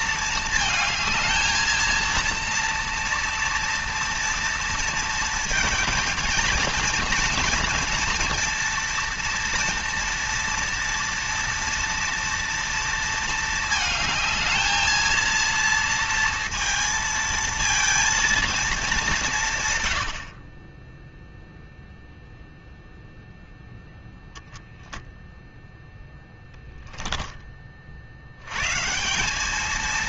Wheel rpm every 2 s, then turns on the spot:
220, 230, 230, 230, 230, 230, 230, 220, 230, 200, 20, 0, 0, 10, 140.
none